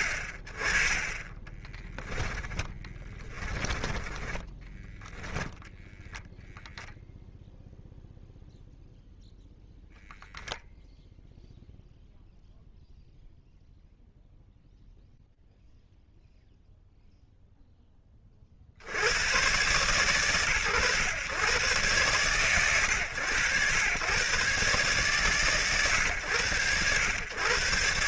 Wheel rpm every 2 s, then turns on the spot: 10, 20, 10, 0, 0, 0, 0, 0, 0, 100, 110, 90, 140, 120.
0-4